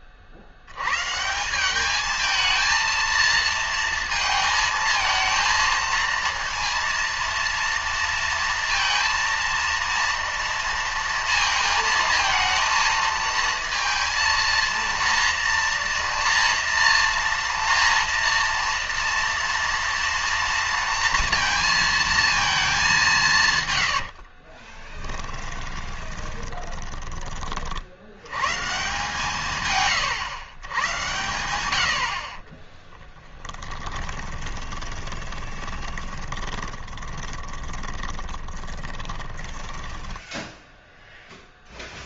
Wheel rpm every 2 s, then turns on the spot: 120, 220, 220, 230, 230, 230, 230, 230, 230, 230, 230, 200, 30, 20, 160, 110, 20, 20, 20, 20, 0.
24-28 32-40